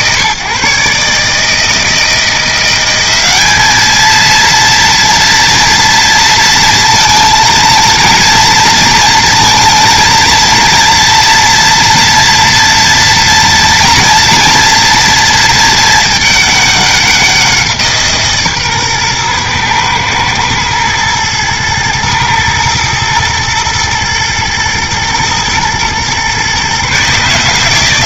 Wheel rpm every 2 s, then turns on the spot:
150, 180, 230, 230, 230, 230, 230, 230, 200, 140, 110, 110, 120, 130.
none